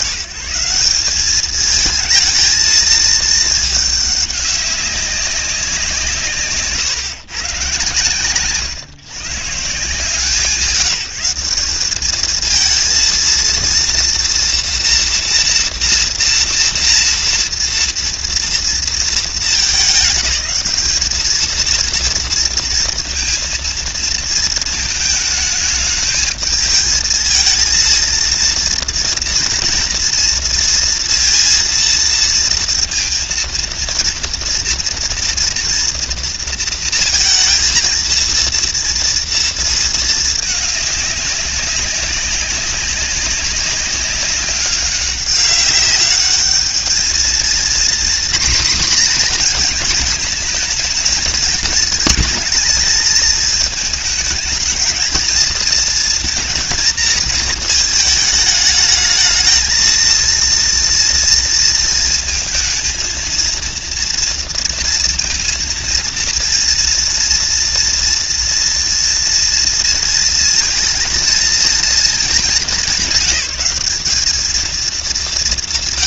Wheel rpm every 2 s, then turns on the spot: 140, 220, 200, 150, 130, 160, 220, 230, 240, 230, 210, 230, 220, 220, 230, 230, 230, 230, 230, 230, 210, 190, 200, 210, 250, 220, 220, 220, 230, 210, 230, 230, 230, 230, 230, 230, 210, 210.
none